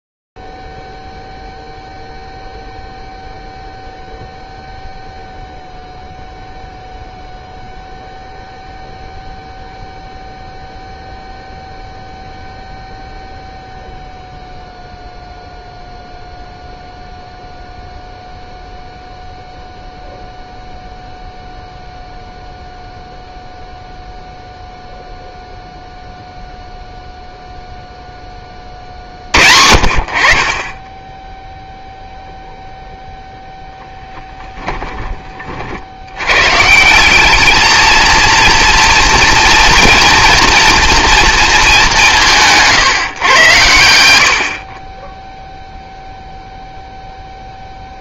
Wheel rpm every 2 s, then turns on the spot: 0, 0, 0, 0, 0, 0, 0, 0, 0, 0, 0, 0, 0, 0, 20, 40, 0, 10, 130, 230, 240, 160, 30, 0.
42-44